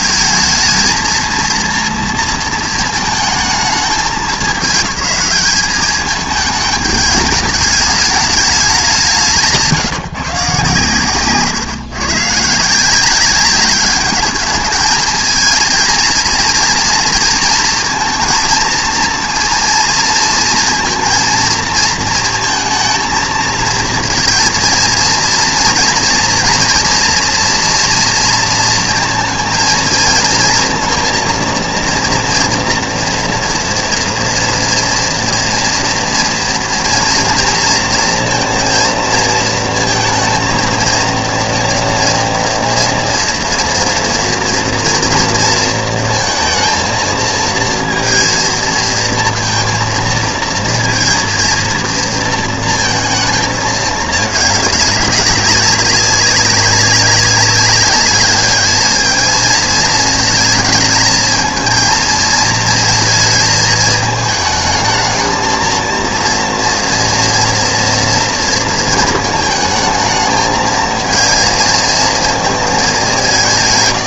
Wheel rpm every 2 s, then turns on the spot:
230, 230, 210, 210, 210, 140, 150, 220, 230, 230, 230, 230, 230, 230, 230, 230, 240, 230, 230, 230, 230, 240, 230, 230, 230, 230, 230, 210, 200, 210, 220, 220, 210, 230, 230, 220, 220.
none